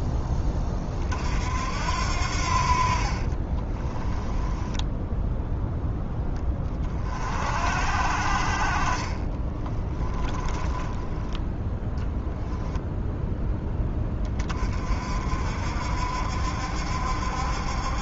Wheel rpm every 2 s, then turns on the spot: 40, 50, 10, 30, 40, 10, 0, 40, 70.
4-6 10-12